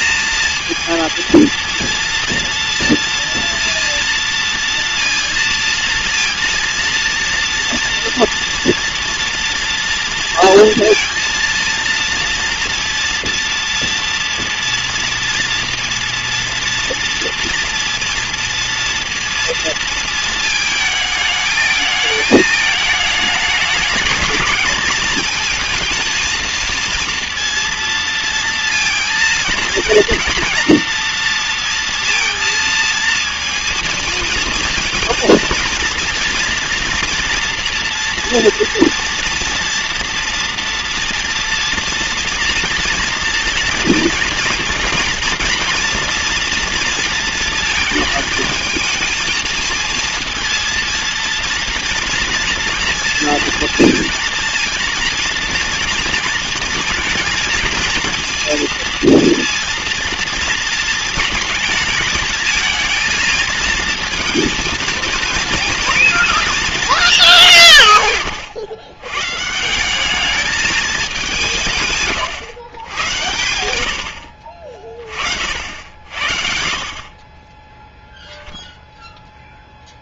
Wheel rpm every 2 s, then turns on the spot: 230, 230, 230, 230, 240, 230, 230, 230, 230, 240, 220, 220, 220, 230, 220, 230, 220, 220, 230, 240, 230, 230, 230, 230, 220, 230, 230, 240, 230, 230, 220, 230, 230, 220, 110, 210, 100, 40, 30, 0.
none